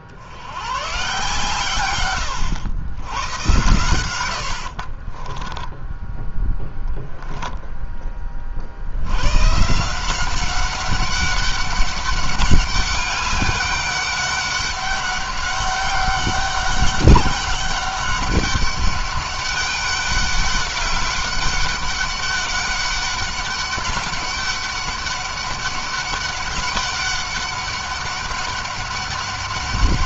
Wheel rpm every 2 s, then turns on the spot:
100, 110, 50, 10, 70, 190, 200, 200, 200, 200, 190, 200, 200, 200, 200.
4-6